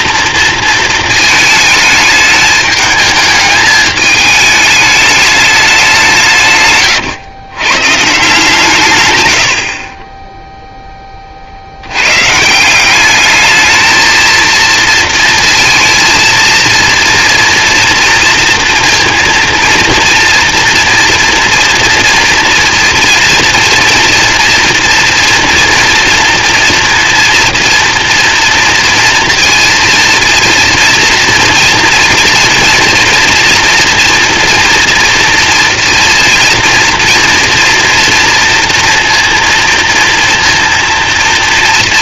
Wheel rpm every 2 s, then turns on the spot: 230, 220, 210, 140, 140, 10, 170, 230, 230, 230, 230, 230, 240, 230, 230, 230, 230, 230, 230, 230, 230.
none